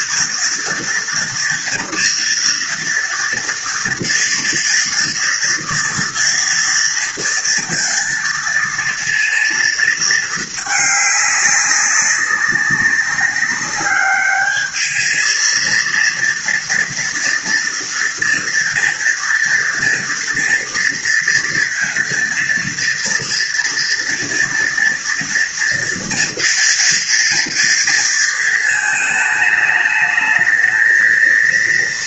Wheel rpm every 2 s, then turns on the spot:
240, 230, 230, 230, 230, 210, 200, 220, 230, 230, 230, 230, 230, 230, 220, 220.
none